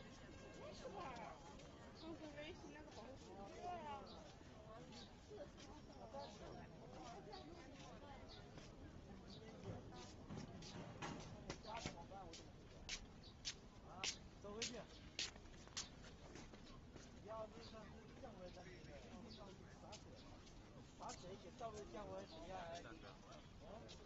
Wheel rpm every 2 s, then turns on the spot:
0, 0, 0, 0, 0, 0, 0, 0, 0, 0, 0, 0.
none